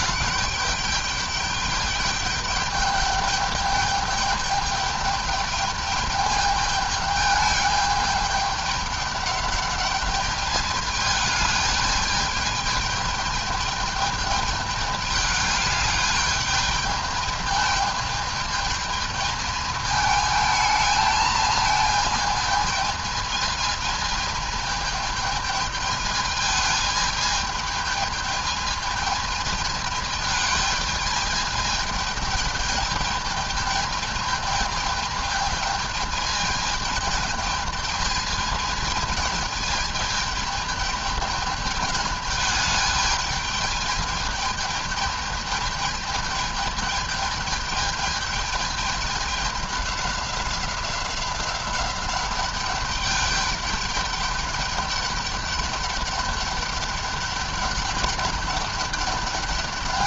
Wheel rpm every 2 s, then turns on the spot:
200, 210, 210, 210, 210, 210, 210, 210, 210, 220, 220, 220, 220, 220, 220, 210, 220, 220, 220, 220, 210, 210, 210, 210, 210, 190, 200, 200, 200, 200.
none